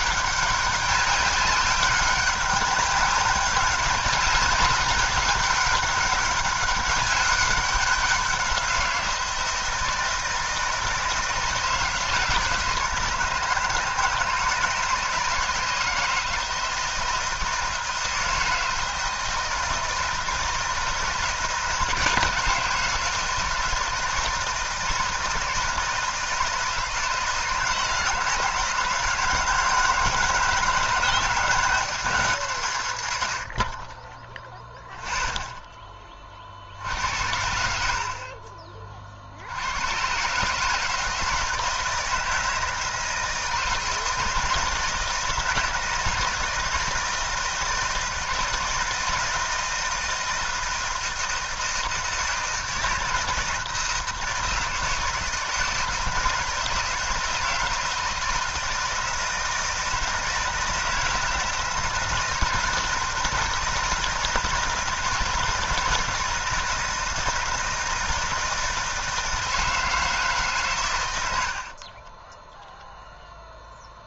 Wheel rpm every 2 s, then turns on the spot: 200, 200, 200, 200, 180, 160, 160, 160, 160, 160, 160, 160, 160, 160, 170, 160, 140, 0, 60, 40, 150, 160, 160, 160, 160, 170, 160, 160, 160, 160, 160, 160, 160, 160, 160, 130, 0.
none